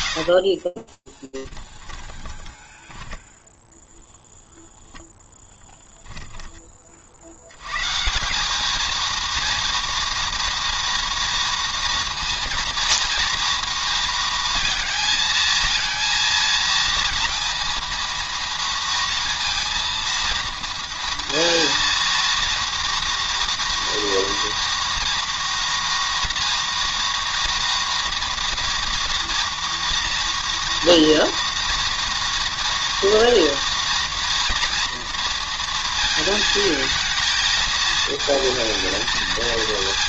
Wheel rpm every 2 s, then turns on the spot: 30, 10, 0, 30, 220, 230, 230, 220, 230, 230, 230, 230, 230, 230, 230, 240, 230, 230, 220, 220.
0-4